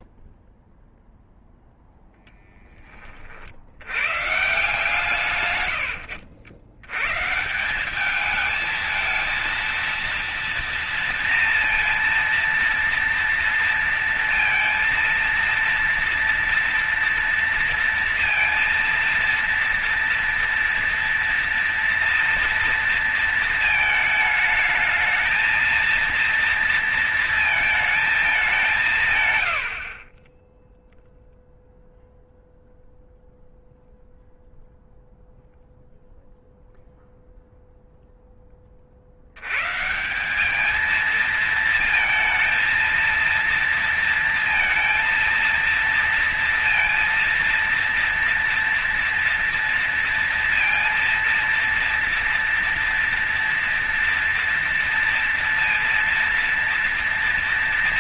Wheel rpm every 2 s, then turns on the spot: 0, 10, 130, 90, 210, 230, 230, 230, 230, 230, 240, 230, 220, 230, 200, 20, 0, 0, 0, 20, 180, 230, 230, 230, 230, 230, 230, 230, 230.
none